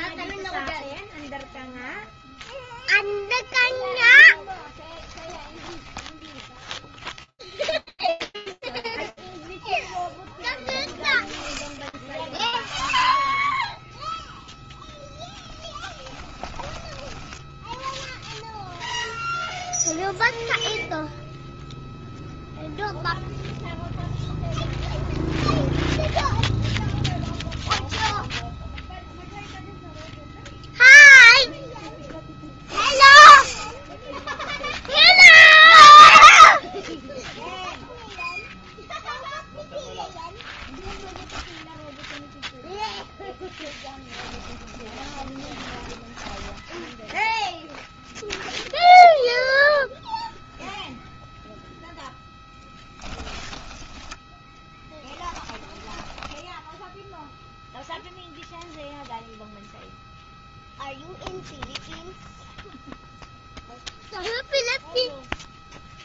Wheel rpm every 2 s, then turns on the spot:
0, 0, 10, 0, 0, 0, 20, 0, 10, 0, 0, 0, 0, 0, 0, 0, 40, 10, 0, 0, 10, 0, 30, 0, 0, 0, 10, 10, 0, 0, 0, 0, 0.
4-6 16-18 44-46 52-56